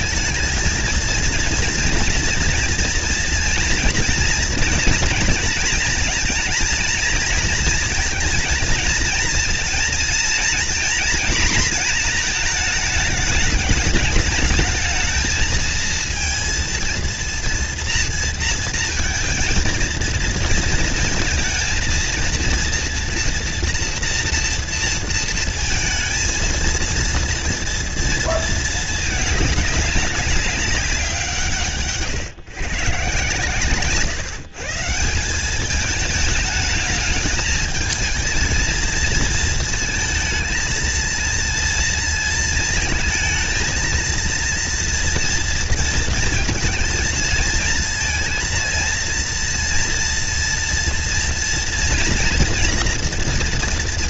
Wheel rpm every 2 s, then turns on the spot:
220, 230, 230, 230, 230, 230, 230, 210, 230, 230, 230, 230, 230, 230, 220, 190, 140, 150, 220, 230, 230, 220, 230, 230, 230, 230, 230.
none